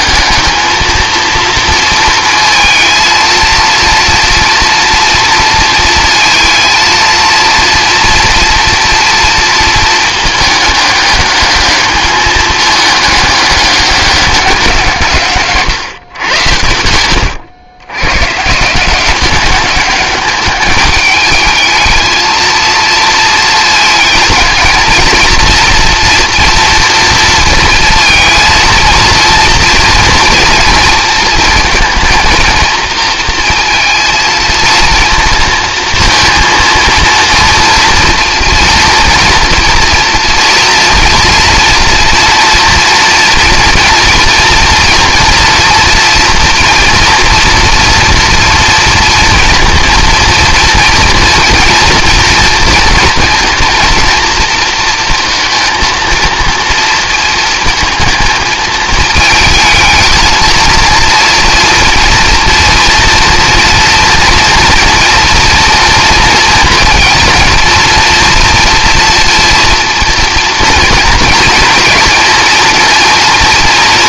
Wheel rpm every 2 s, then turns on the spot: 220, 230, 230, 230, 240, 210, 210, 170, 90, 170, 210, 230, 230, 230, 230, 230, 230, 230, 230, 230, 230, 230, 240, 230, 230, 230, 230, 230, 230, 220, 230, 230, 230, 230, 230, 230, 230.
16-18